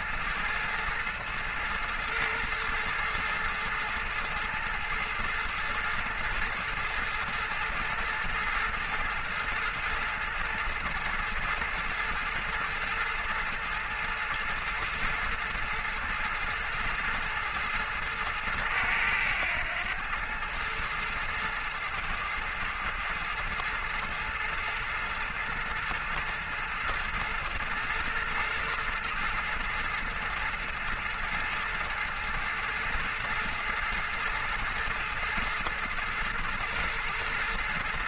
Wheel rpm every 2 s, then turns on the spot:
110, 110, 110, 110, 110, 110, 110, 110, 110, 110, 110, 110, 110, 110, 110, 110, 110, 110, 120.
none